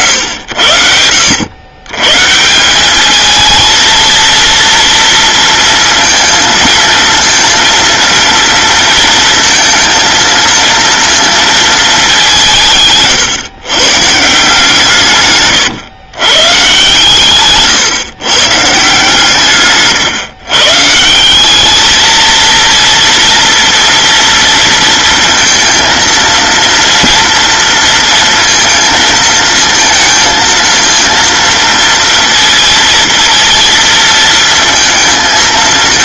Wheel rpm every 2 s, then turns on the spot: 80, 170, 230, 220, 230, 230, 170, 150, 130, 130, 140, 230, 230, 230, 230, 230, 230, 230.
none